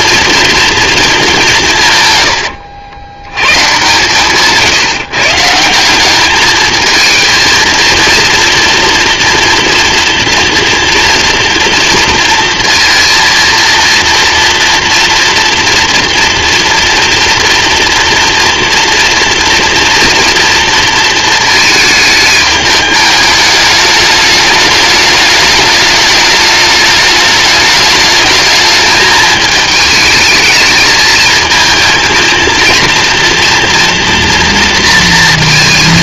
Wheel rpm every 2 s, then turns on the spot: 230, 80, 150, 220, 230, 230, 230, 230, 230, 240, 230, 210, 210, 210, 210, 220, 230, 230.
2-4